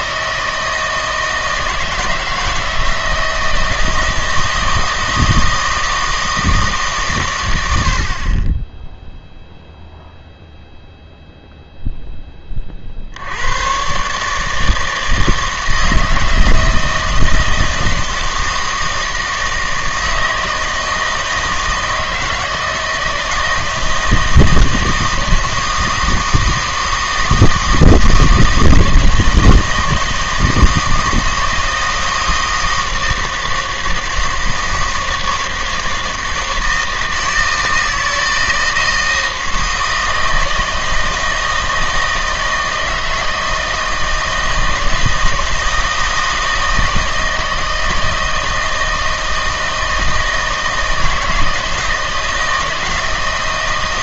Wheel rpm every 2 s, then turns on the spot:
160, 160, 160, 150, 10, 0, 50, 160, 160, 160, 160, 160, 160, 160, 160, 160, 160, 160, 160, 160, 160, 160, 160, 160, 160, 160, 160.
none